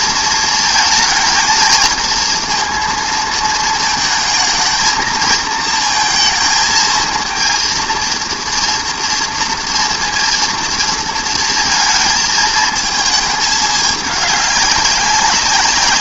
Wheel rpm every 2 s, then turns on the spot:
230, 220, 220, 220, 230, 240, 220, 210.
none